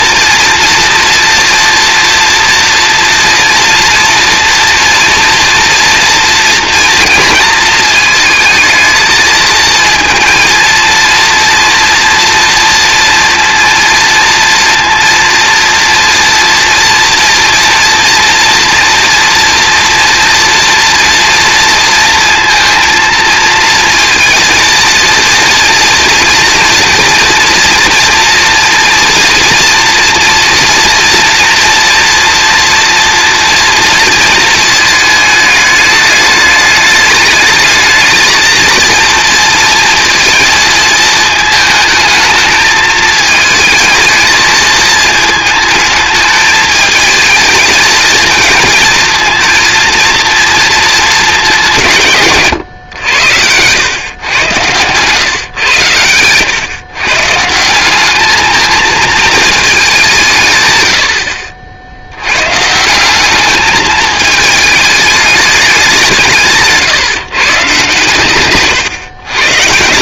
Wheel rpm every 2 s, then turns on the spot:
240, 230, 230, 230, 220, 230, 230, 230, 230, 240, 230, 230, 230, 230, 230, 230, 240, 220, 210, 230, 230, 220, 220, 220, 220, 220, 120, 110, 130, 220, 110, 140, 210, 150, 130.
68-70